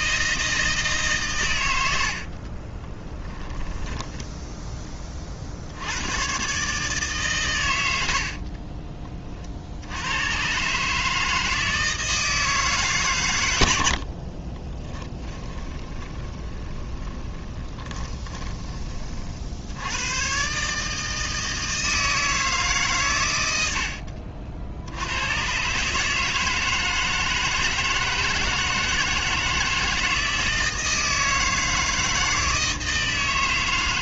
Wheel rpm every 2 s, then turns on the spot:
160, 20, 20, 140, 40, 140, 140, 20, 20, 30, 150, 140, 70, 160, 160, 160, 160.
2-4 8-10 14-18